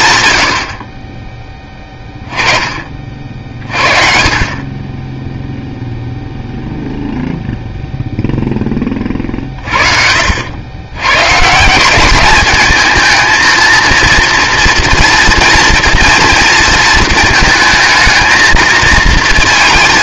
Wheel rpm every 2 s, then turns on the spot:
80, 30, 20, 0, 20, 90, 210, 230, 230, 230.
none